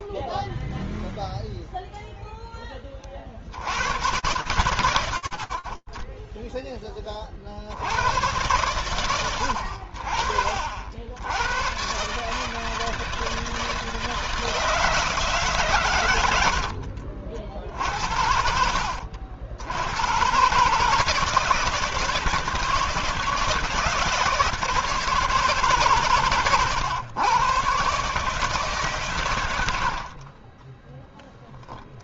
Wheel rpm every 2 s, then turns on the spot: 10, 0, 100, 20, 110, 80, 160, 160, 50, 60, 140, 160, 160, 120, 130, 10.
30-32